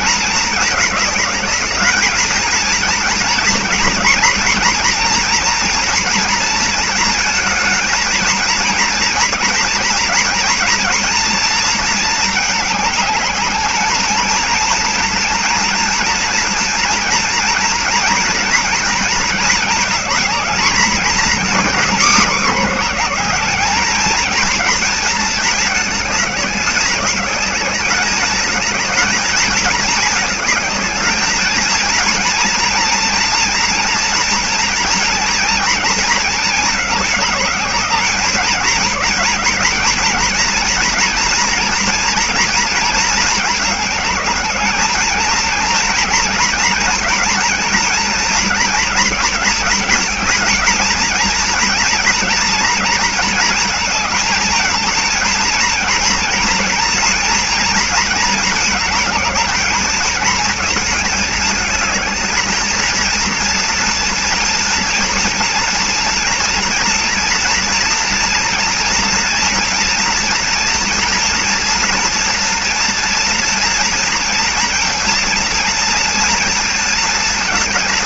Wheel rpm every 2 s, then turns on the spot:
220, 230, 240, 230, 230, 230, 210, 230, 230, 230, 220, 200, 220, 200, 220, 210, 230, 230, 210, 210, 230, 230, 210, 230, 230, 230, 230, 220, 230, 220, 220, 220, 230, 230, 230, 230, 230, 230, 230.
none